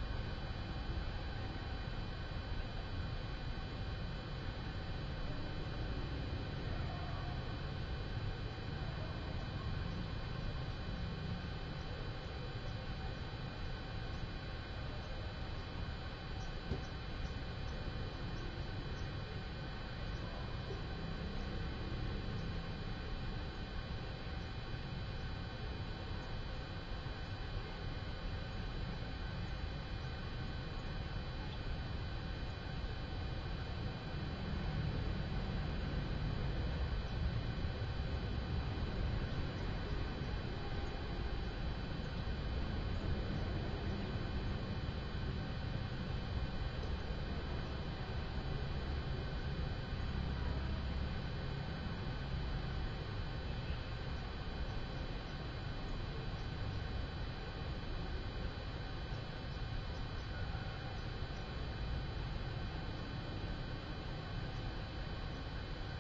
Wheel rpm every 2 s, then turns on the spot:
0, 0, 0, 0, 0, 0, 0, 0, 0, 0, 0, 0, 0, 0, 0, 0, 0, 0, 0, 0, 0, 0, 0, 0, 0, 0, 0, 0, 0, 0, 0, 0, 0.
none